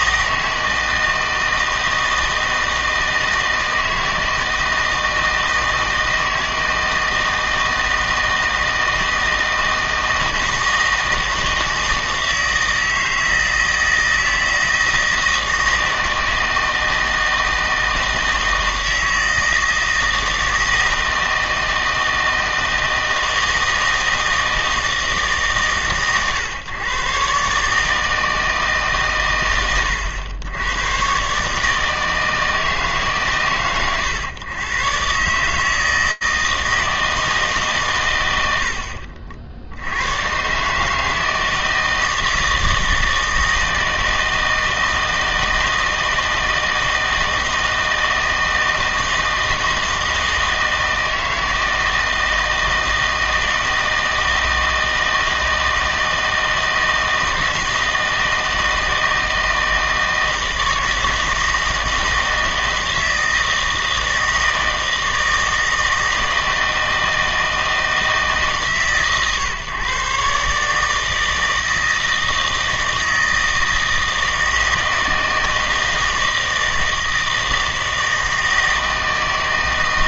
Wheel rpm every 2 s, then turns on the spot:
160, 160, 160, 160, 160, 160, 160, 160, 160, 160, 160, 160, 160, 130, 140, 110, 150, 130, 160, 80, 150, 160, 160, 160, 160, 160, 160, 160, 160, 160, 160, 160, 160, 160, 140, 150, 160, 160, 160, 160.
none